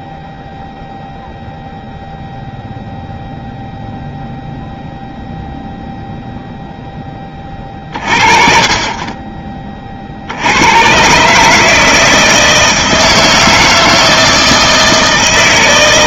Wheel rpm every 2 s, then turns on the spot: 0, 0, 0, 0, 40, 60, 160, 160.
none